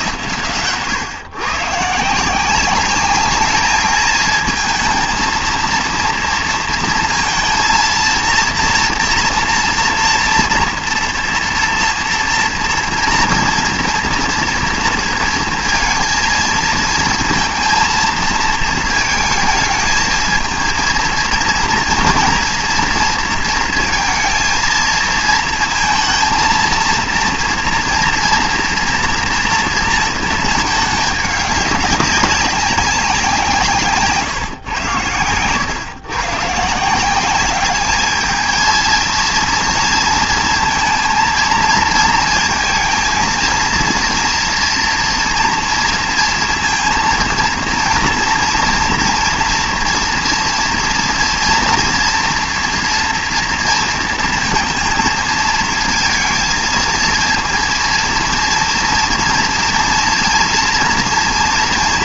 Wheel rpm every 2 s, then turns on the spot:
120, 190, 220, 230, 230, 230, 230, 230, 230, 220, 230, 230, 230, 230, 230, 220, 200, 140, 140, 220, 230, 220, 230, 230, 230, 240, 240, 220, 230, 230, 230.
none